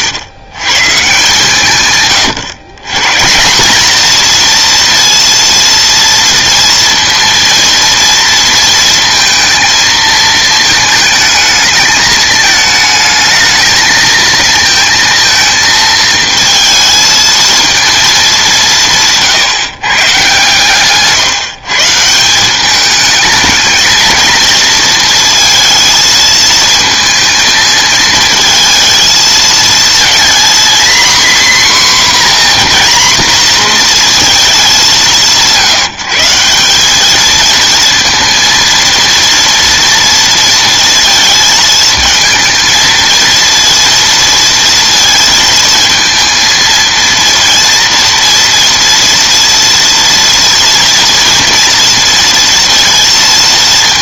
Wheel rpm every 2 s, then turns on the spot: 130, 130, 240, 230, 230, 220, 220, 230, 220, 170, 140, 200, 230, 220, 230, 240, 250, 200, 200, 230, 230, 230, 230, 230, 230, 230, 230.
none